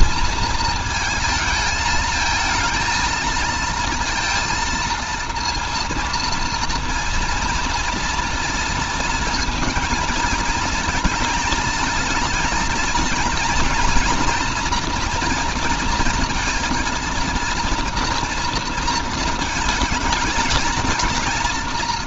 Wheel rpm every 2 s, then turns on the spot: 230, 220, 230, 230, 230, 220, 230, 240, 230, 230, 220.
none